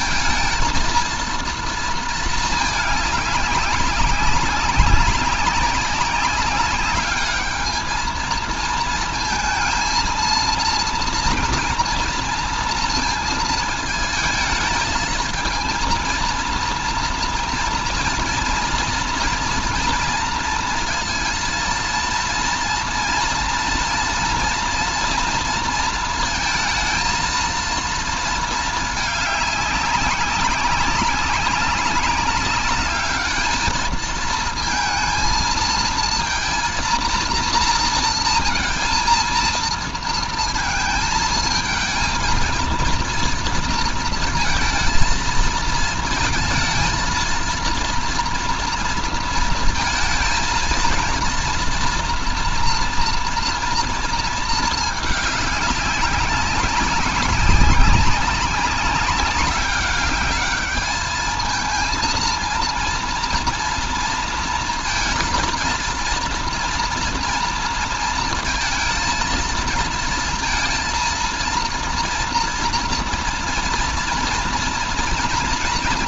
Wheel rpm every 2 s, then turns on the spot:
230, 210, 190, 200, 230, 230, 230, 220, 230, 230, 230, 230, 230, 220, 220, 190, 210, 220, 230, 230, 230, 230, 230, 230, 230, 230, 240, 220, 190, 200, 210, 230, 230, 230, 230, 230, 230, 230.
none